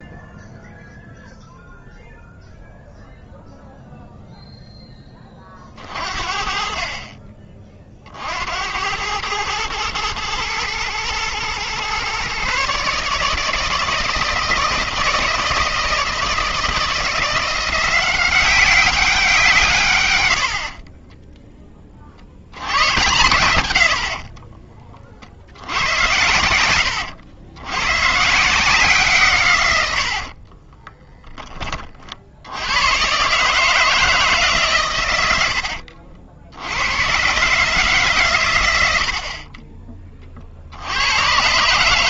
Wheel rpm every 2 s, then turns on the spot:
0, 0, 10, 50, 80, 110, 140, 160, 170, 190, 60, 100, 30, 90, 170, 30, 100, 150, 80, 100, 70.
30-32